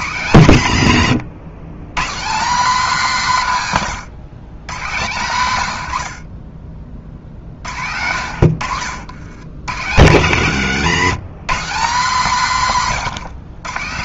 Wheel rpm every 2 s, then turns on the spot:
110, 230, 120, 40, 80, 130, 170.
none